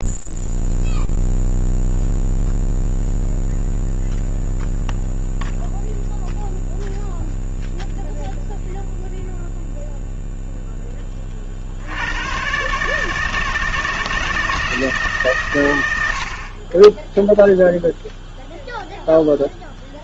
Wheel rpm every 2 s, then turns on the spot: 0, 0, 0, 0, 0, 10, 140, 160, 20, 0.
none